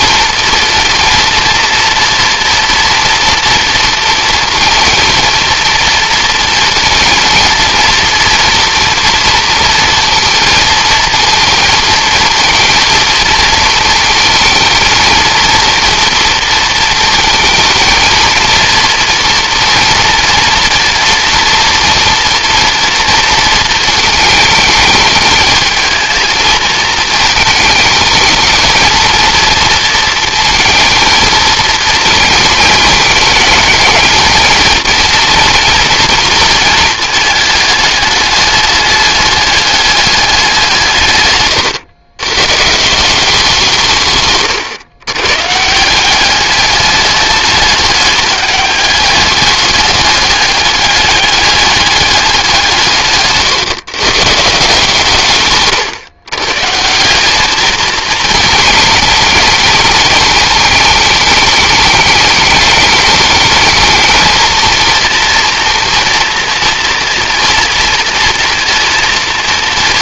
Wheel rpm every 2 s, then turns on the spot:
230, 230, 230, 230, 230, 230, 230, 220, 230, 230, 230, 230, 220, 220, 230, 230, 230, 230, 220, 210, 170, 150, 130, 200, 210, 200, 160, 150, 150, 220, 220, 210, 230, 230, 230.
none